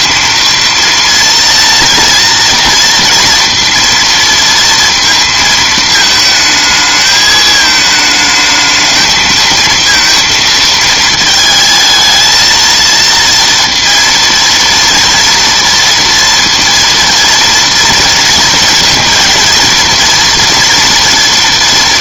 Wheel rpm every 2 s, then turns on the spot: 230, 230, 230, 220, 220, 230, 230, 230, 230, 230, 230.
none